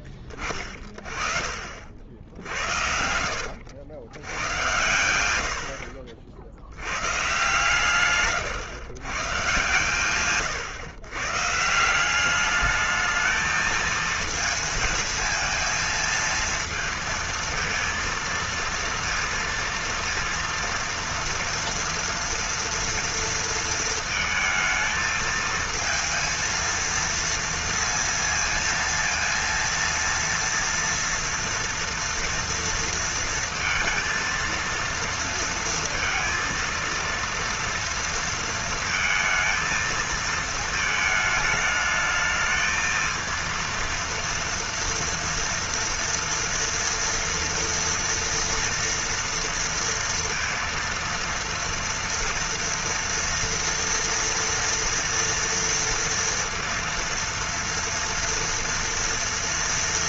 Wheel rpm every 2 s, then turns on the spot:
30, 60, 90, 100, 120, 130, 210, 220, 220, 230, 230, 230, 220, 230, 230, 230, 230, 230, 230, 230, 220, 220, 230, 230, 230, 230, 230, 230, 230, 230.
2-4